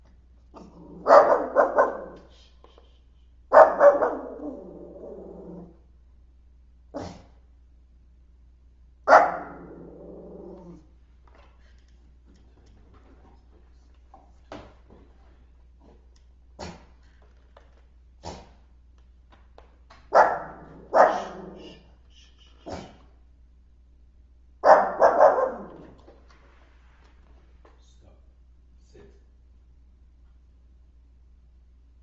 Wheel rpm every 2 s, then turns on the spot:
0, 0, 0, 0, 0, 0, 0, 0, 0, 0, 0, 0, 0, 0, 0, 0.
none